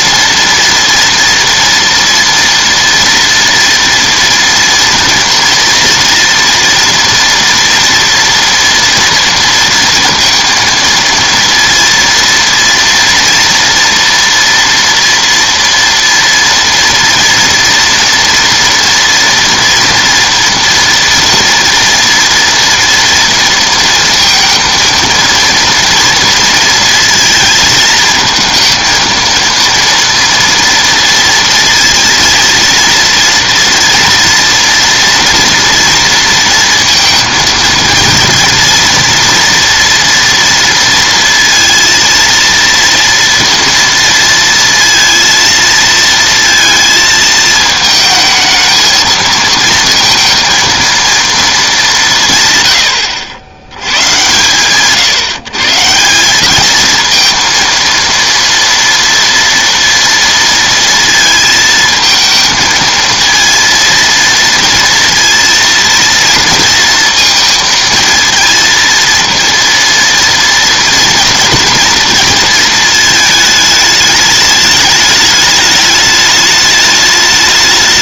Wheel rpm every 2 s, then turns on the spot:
230, 230, 230, 230, 230, 230, 230, 230, 230, 230, 230, 230, 230, 230, 230, 230, 230, 230, 230, 230, 230, 230, 230, 230, 220, 230, 120, 130, 210, 230, 230, 220, 230, 230, 230, 230, 220, 210, 210.
none